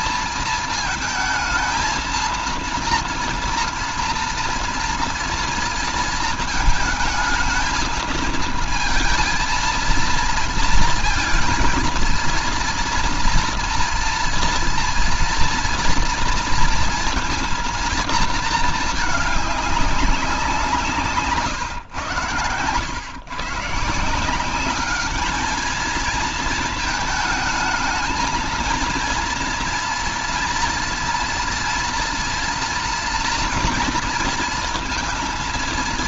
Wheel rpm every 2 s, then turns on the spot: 230, 230, 230, 220, 230, 220, 230, 230, 230, 220, 160, 110, 200, 220, 220, 230, 230, 230.
none